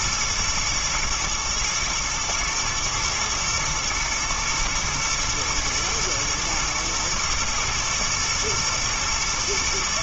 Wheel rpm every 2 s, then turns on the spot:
120, 110, 120, 120, 120.
none